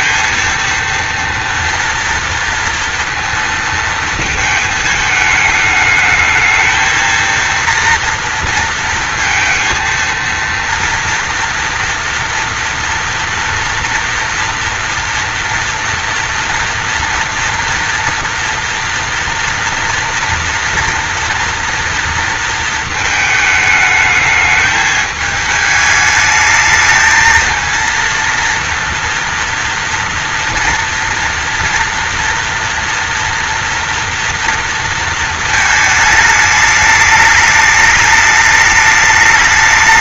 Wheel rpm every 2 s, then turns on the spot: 230, 230, 220, 220, 230, 230, 240, 240, 230, 230, 230, 220, 220, 220, 230, 230, 230, 230, 220, 210.
none